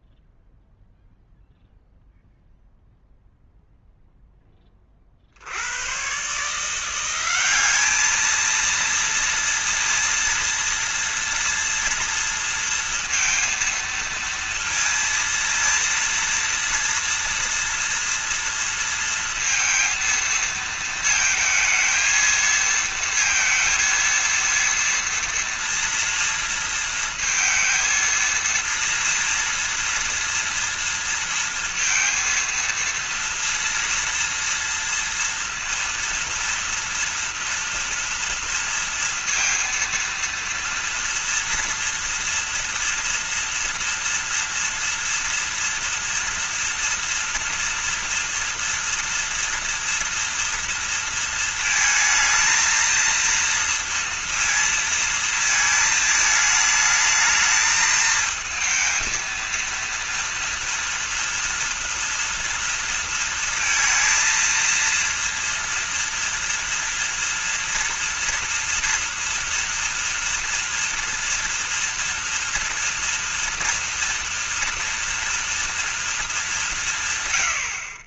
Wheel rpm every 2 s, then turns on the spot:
0, 0, 20, 170, 230, 230, 230, 230, 230, 230, 230, 230, 230, 230, 230, 230, 230, 230, 230, 230, 230, 230, 230, 240, 230, 230, 230, 230, 220, 220, 230, 230, 230, 230, 240, 230, 230, 230, 170.
none